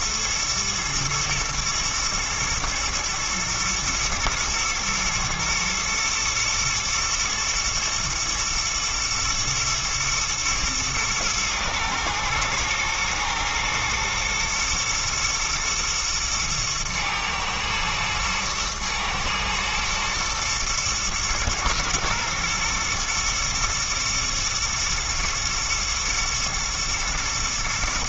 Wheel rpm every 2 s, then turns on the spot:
110, 120, 120, 120, 110, 120, 110, 120, 120, 110, 110, 120, 120, 120.
none